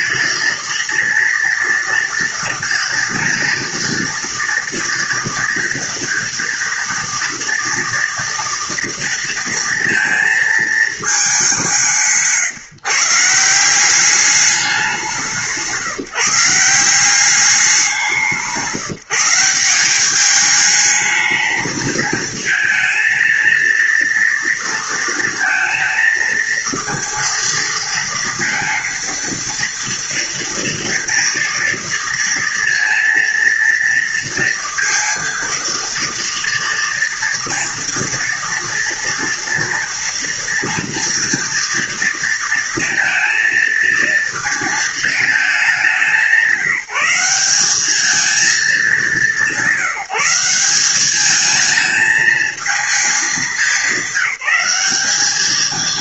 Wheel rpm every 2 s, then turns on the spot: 230, 230, 230, 230, 230, 220, 150, 190, 180, 170, 220, 220, 230, 230, 230, 240, 230, 230, 230, 230, 240, 230, 220, 190, 210, 190, 220, 190.
none